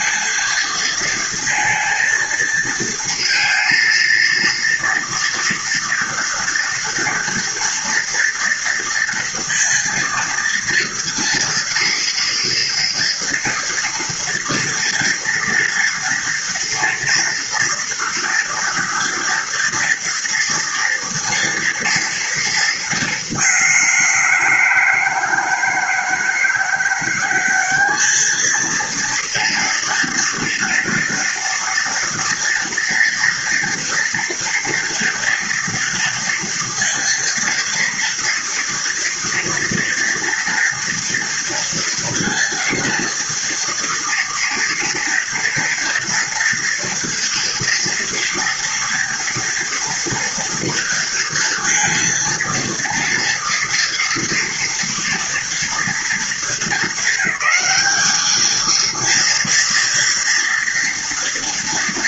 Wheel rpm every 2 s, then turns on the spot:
230, 230, 240, 230, 230, 230, 230, 230, 230, 230, 230, 210, 160, 190, 230, 230, 230, 230, 230, 230, 230, 230, 230, 230, 230, 230, 230, 240, 220, 230, 230.
none